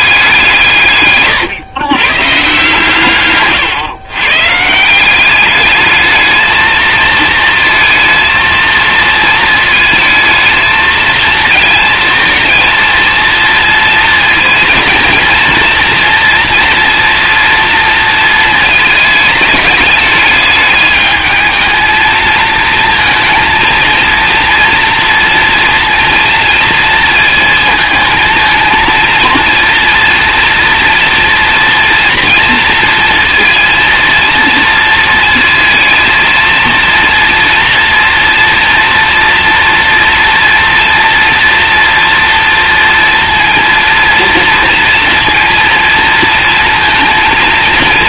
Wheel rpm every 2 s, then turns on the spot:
160, 140, 160, 220, 220, 220, 230, 220, 230, 220, 210, 220, 230, 230, 230, 230, 230, 230, 230, 230, 230, 230, 230, 230.
none